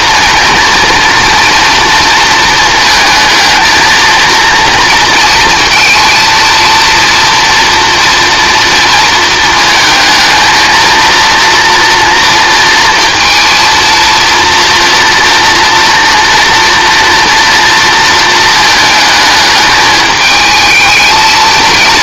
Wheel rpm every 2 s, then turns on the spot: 240, 220, 230, 230, 230, 220, 230, 230, 230, 220, 220.
none